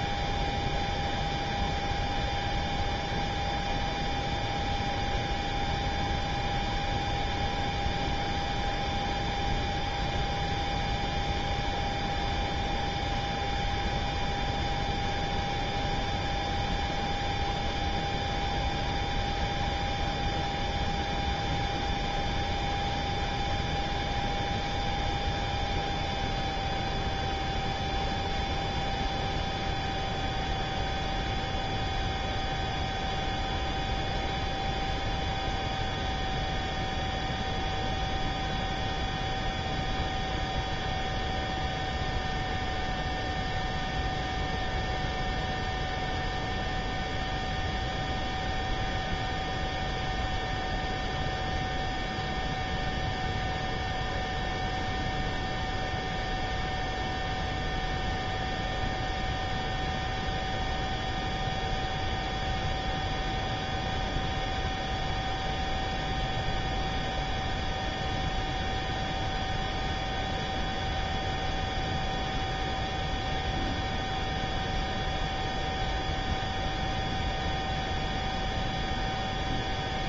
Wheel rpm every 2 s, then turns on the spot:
0, 0, 0, 0, 0, 0, 0, 0, 0, 0, 0, 0, 0, 0, 0, 0, 0, 0, 0, 0, 0, 0, 0, 0, 0, 0, 0, 0, 0, 0, 0, 0, 0, 0, 0, 0, 0, 0, 0, 0.
none